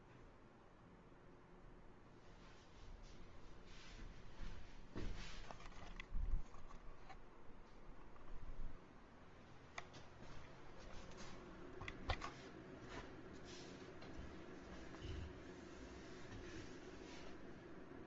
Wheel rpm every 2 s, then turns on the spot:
0, 0, 0, 0, 0, 0, 0, 0, 0.
none